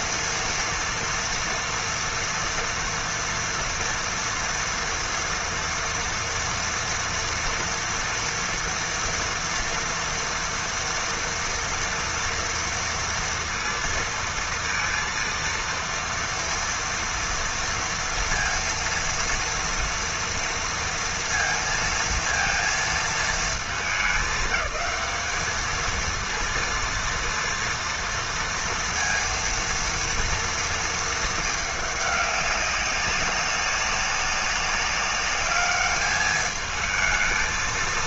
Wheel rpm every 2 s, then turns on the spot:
230, 230, 230, 230, 230, 230, 230, 230, 230, 230, 230, 230, 200, 230, 230, 230, 200, 200, 220.
none